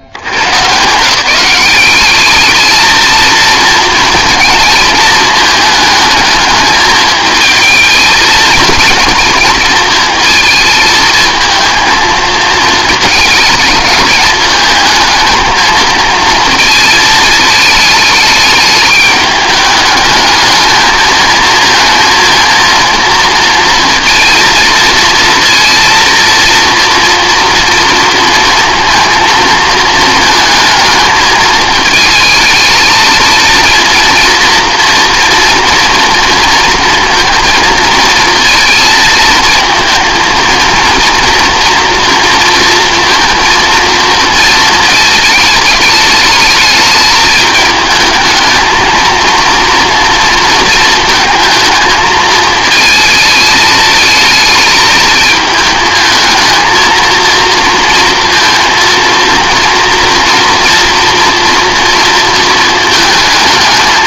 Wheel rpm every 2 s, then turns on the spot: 90, 210, 220, 210, 230, 220, 220, 220, 230, 210, 220, 230, 230, 230, 230, 220, 220, 230, 230, 230, 230, 230, 230, 220, 220, 230, 220, 220, 220, 230, 230, 230.
none